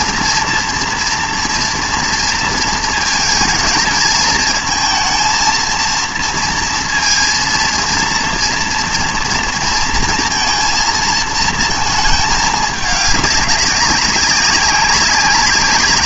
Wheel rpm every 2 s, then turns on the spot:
240, 230, 230, 230, 230, 230, 210, 190.
none